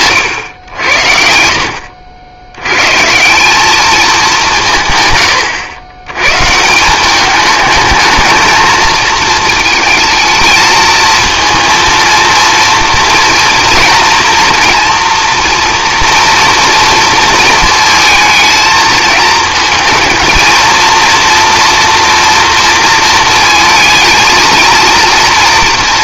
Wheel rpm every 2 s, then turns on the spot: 80, 130, 150, 180, 220, 220, 230, 230, 230, 220, 230, 230, 230.
none